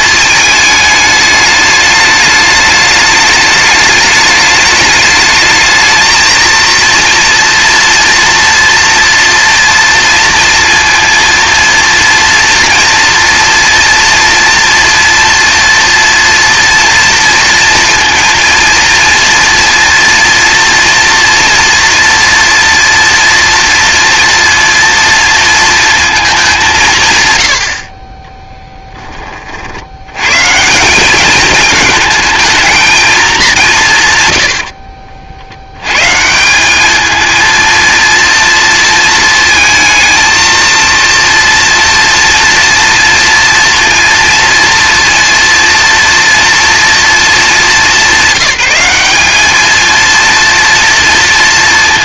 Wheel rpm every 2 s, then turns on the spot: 210, 210, 210, 230, 230, 230, 230, 230, 230, 230, 230, 230, 230, 180, 10, 160, 220, 60, 200, 220, 230, 230, 230, 230, 190, 230.
34-36